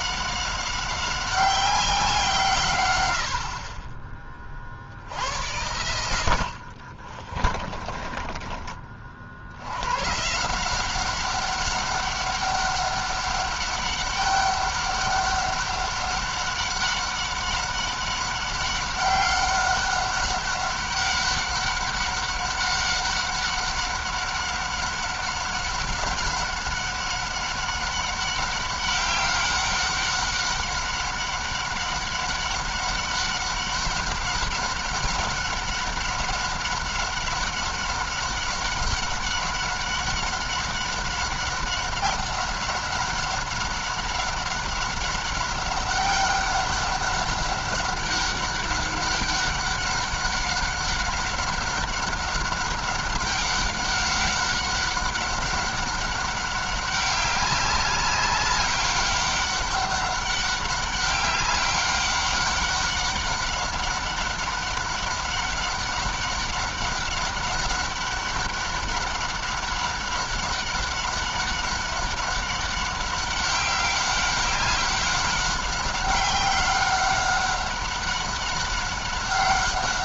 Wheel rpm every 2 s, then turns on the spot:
190, 130, 50, 60, 30, 170, 200, 200, 190, 190, 200, 200, 200, 200, 200, 200, 200, 200, 200, 190, 200, 190, 200, 200, 190, 190, 190, 200, 200, 200, 190, 200, 190, 190, 200, 200, 190, 190, 190, 200.
6-8